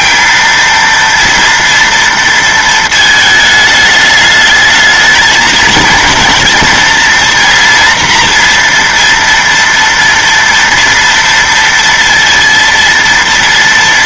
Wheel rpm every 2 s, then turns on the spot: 230, 230, 210, 230, 230, 230, 230.
none